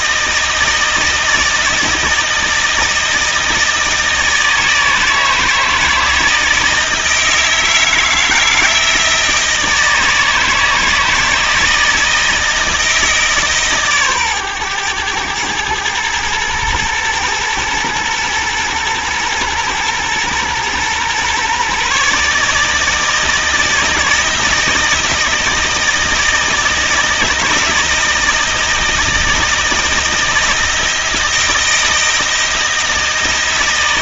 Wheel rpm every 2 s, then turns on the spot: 160, 160, 160, 160, 160, 160, 160, 110, 110, 120, 120, 160, 160, 160, 160, 170, 160.
none